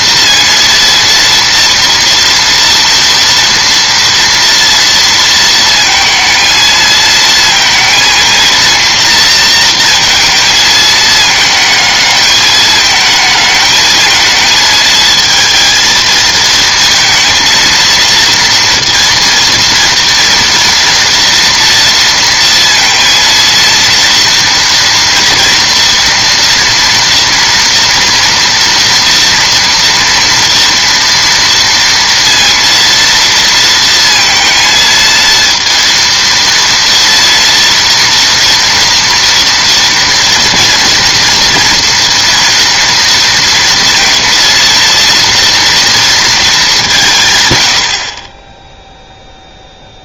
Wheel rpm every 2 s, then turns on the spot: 230, 230, 230, 230, 230, 220, 210, 220, 230, 230, 230, 230, 230, 230, 230, 230, 230, 220, 230, 230, 240, 230, 230, 190, 0.
none